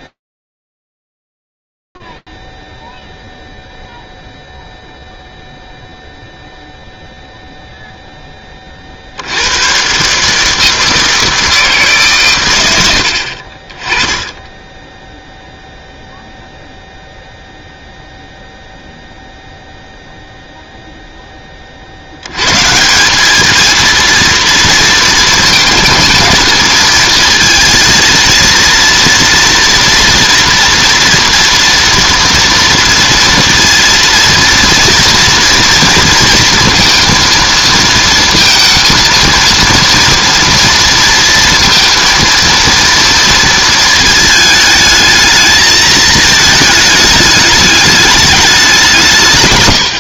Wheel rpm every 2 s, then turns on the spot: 0, 0, 0, 0, 20, 150, 110, 10, 0, 0, 0, 140, 230, 220, 230, 230, 230, 230, 230, 230, 230, 230, 220, 220, 200.
none